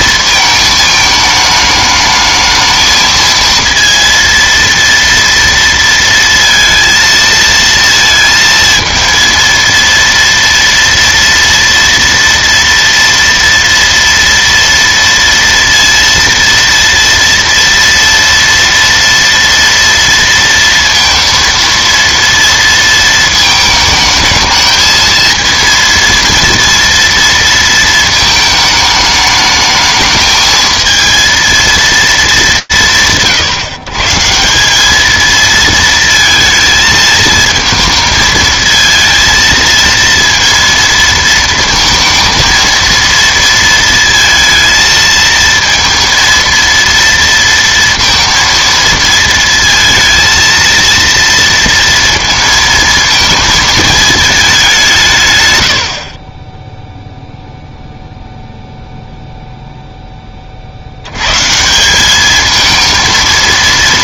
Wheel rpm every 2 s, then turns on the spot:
220, 220, 230, 230, 230, 230, 240, 230, 230, 230, 230, 230, 220, 230, 220, 220, 100, 200, 220, 230, 230, 230, 220, 230, 230, 230, 230, 180, 10, 0, 100, 230.
none